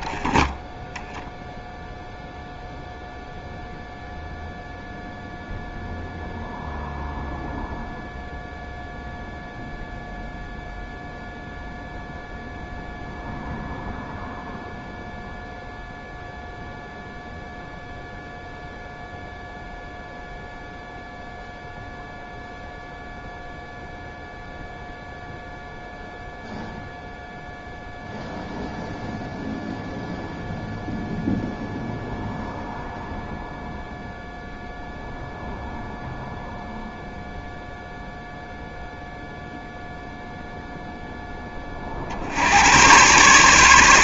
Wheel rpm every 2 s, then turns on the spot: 10, 0, 0, 0, 0, 0, 0, 0, 0, 0, 0, 0, 0, 0, 0, 0, 0, 0, 0, 0, 0, 100.
0-2